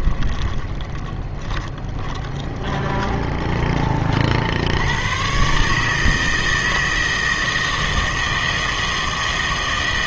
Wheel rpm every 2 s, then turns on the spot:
20, 20, 70, 160, 160.
0-4